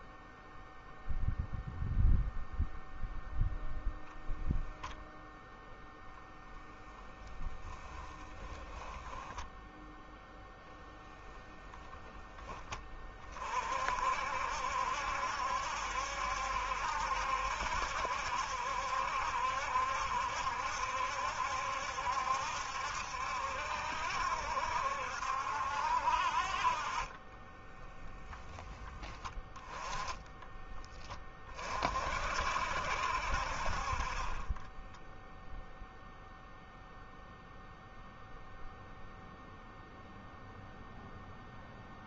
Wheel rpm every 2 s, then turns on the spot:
0, 0, 10, 0, 10, 0, 20, 70, 70, 70, 70, 70, 60, 30, 10, 10, 60, 10, 0, 0, 0.
8-10 26-28 34-36